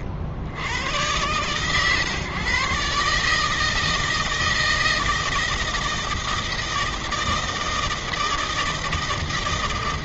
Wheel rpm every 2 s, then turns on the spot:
90, 140, 160, 160, 160.
none